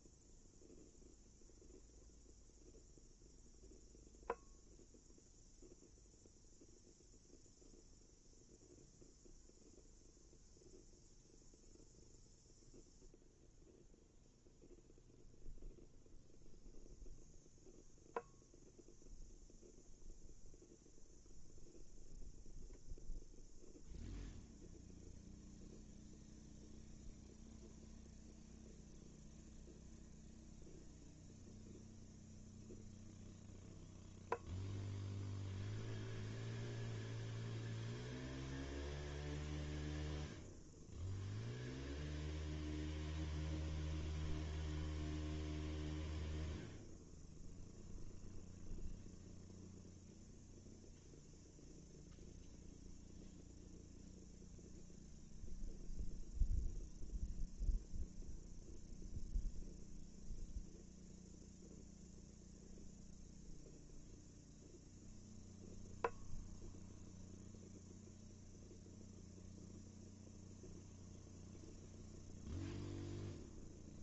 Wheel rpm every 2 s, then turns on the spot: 0, 0, 0, 0, 0, 0, 0, 0, 0, 0, 0, 0, 0, 0, 0, 0, 0, 0, 0, 0, 0, 0, 0, 0, 0, 0, 0, 0, 0, 0, 0, 0, 0, 0, 0, 0, 0.
none